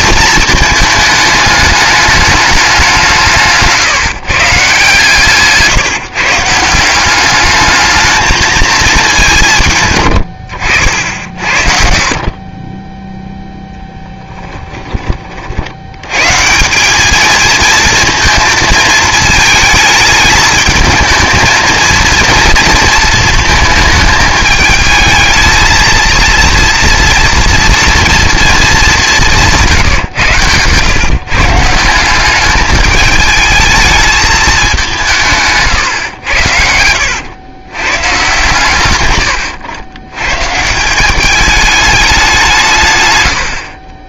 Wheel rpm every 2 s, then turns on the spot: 220, 200, 140, 170, 220, 70, 20, 10, 180, 230, 220, 230, 220, 230, 220, 120, 210, 200, 90, 140, 150, 150.
none